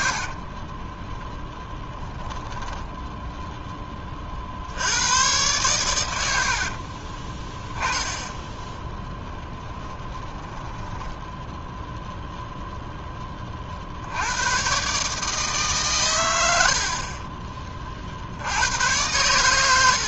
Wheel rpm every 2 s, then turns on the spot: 30, 10, 70, 60, 10, 10, 0, 130, 60, 90.
0-2 6-12